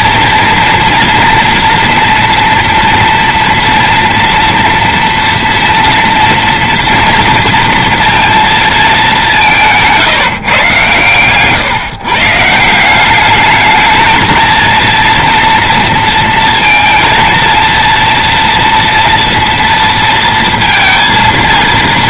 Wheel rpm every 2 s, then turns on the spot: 230, 230, 230, 230, 200, 120, 190, 230, 230, 230, 230.
none